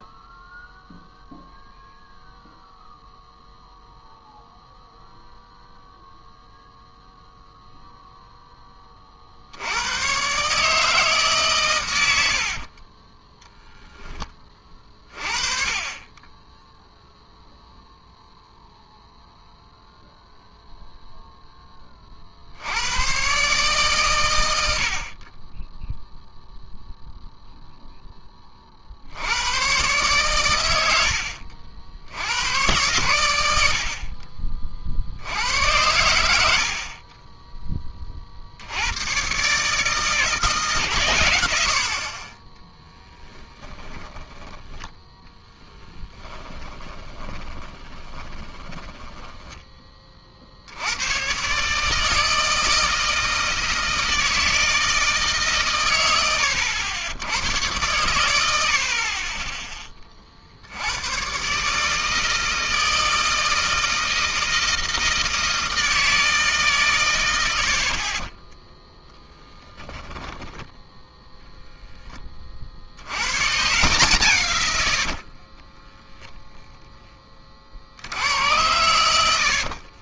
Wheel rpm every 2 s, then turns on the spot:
0, 0, 0, 0, 20, 150, 50, 30, 10, 0, 0, 70, 80, 0, 40, 100, 100, 40, 70, 80, 140, 10, 20, 20, 10, 70, 160, 160, 90, 70, 60, 160, 160, 150, 20, 10, 50, 90, 0, 100.
12-14 42-44 46-50 58-60 68-72